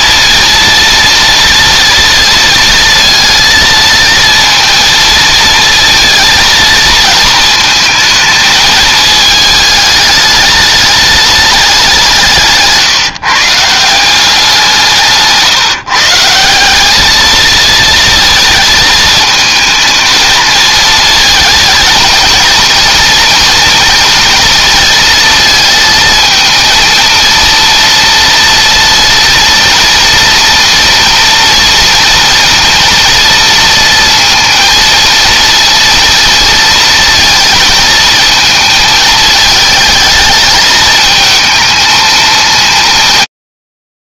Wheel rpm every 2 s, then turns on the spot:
230, 230, 220, 220, 210, 210, 150, 160, 210, 220, 220, 230, 230, 230, 240, 240, 230, 230, 230, 220, 220, 180.
14-16